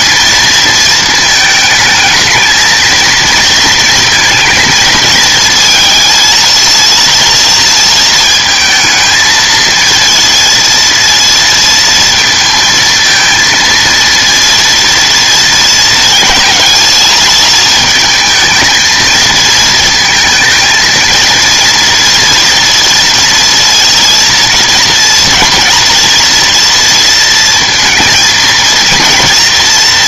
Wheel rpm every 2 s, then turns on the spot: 230, 220, 220, 230, 220, 230, 230, 230, 220, 220, 230, 240, 230, 240, 230.
none